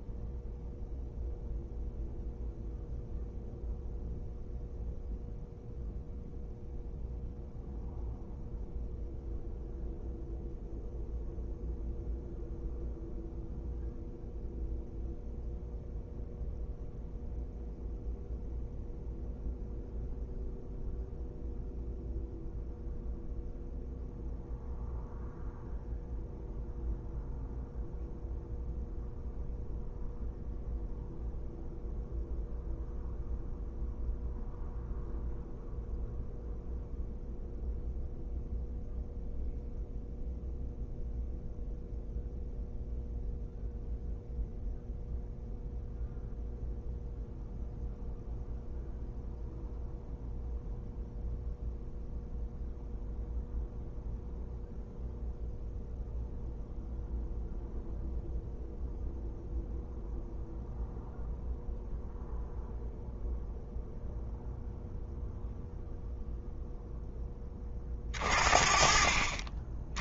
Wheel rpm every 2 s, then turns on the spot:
0, 0, 0, 0, 0, 0, 0, 0, 0, 0, 0, 0, 0, 0, 0, 0, 0, 0, 0, 0, 0, 0, 0, 0, 0, 0, 0, 0, 0, 0, 0, 0, 0, 0, 40.
none